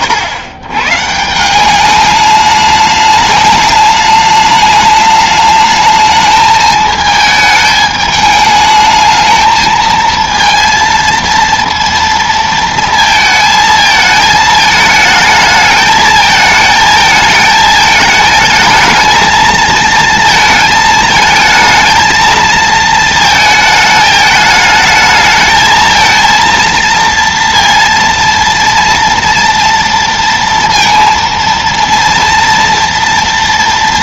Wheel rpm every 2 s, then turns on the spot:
110, 210, 210, 220, 220, 230, 230, 220, 220, 220, 220, 230, 220, 230, 230, 230, 240.
none